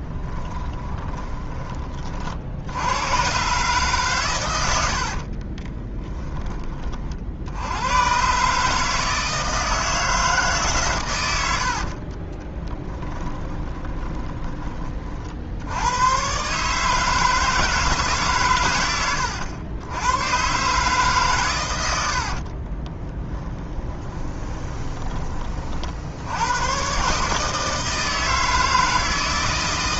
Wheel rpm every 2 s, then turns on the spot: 20, 80, 80, 30, 150, 140, 20, 20, 150, 110, 140, 40, 20, 110, 160.
0-2 12-14 22-26